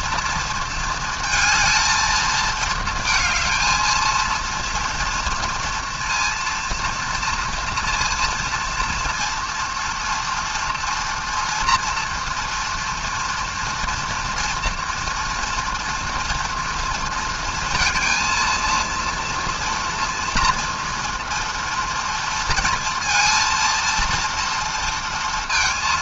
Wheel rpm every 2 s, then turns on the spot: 230, 220, 230, 230, 230, 230, 230, 230, 230, 230, 230, 230, 230.
none